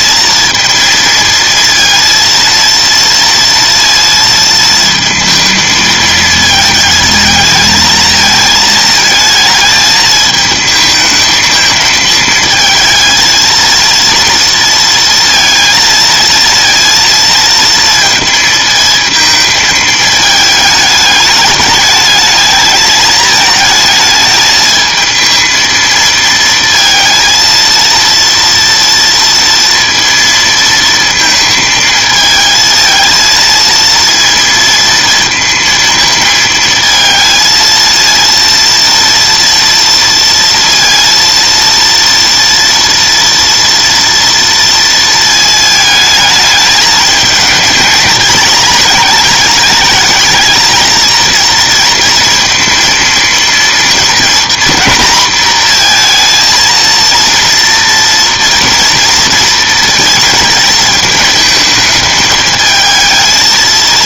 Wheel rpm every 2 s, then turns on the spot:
230, 230, 220, 220, 220, 220, 220, 230, 230, 220, 210, 220, 220, 230, 230, 230, 220, 230, 220, 230, 230, 240, 230, 220, 220, 220, 230, 230, 230, 230, 220, 220.
none